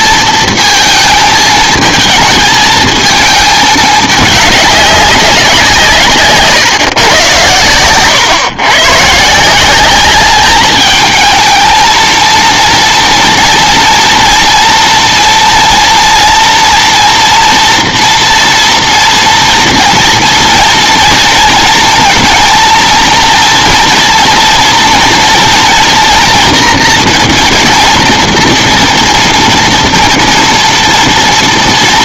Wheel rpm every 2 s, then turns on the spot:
230, 220, 200, 140, 130, 220, 230, 230, 230, 240, 230, 230, 230, 230, 230, 230.
none